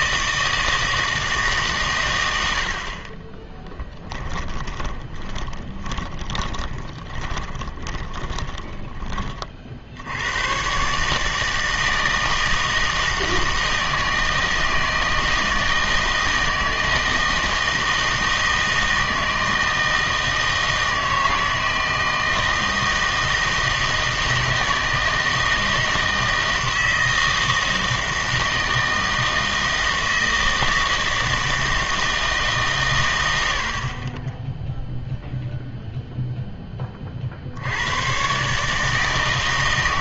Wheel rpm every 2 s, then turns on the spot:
160, 60, 20, 20, 20, 120, 160, 160, 160, 160, 160, 160, 160, 160, 160, 160, 140, 0, 10, 150.
4-10